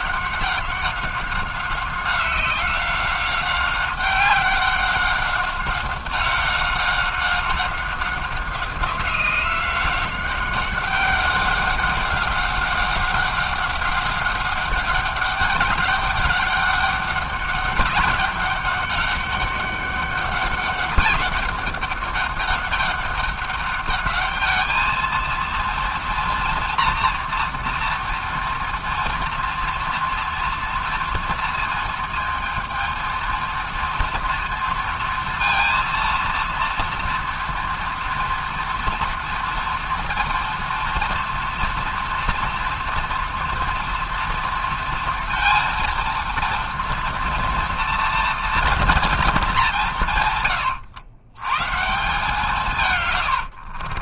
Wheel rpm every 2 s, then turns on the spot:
190, 190, 190, 190, 190, 190, 190, 200, 200, 200, 200, 200, 220, 230, 230, 230, 220, 230, 230, 230, 230, 230, 230, 230, 230, 110, 160.
none